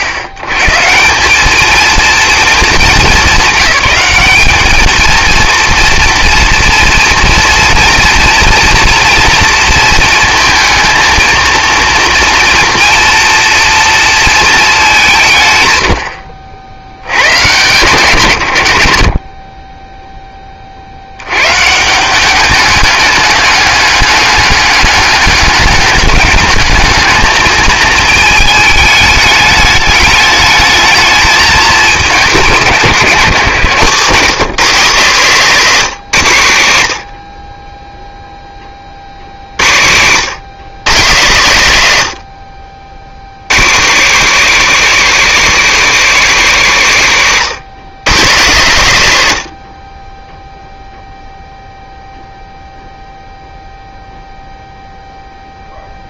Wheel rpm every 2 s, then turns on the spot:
140, 220, 210, 230, 230, 230, 230, 220, 20, 80, 40, 200, 200, 200, 220, 220, 180, 180, 100, 30, 140, 60, 210, 190, 130, 0, 0, 0.
none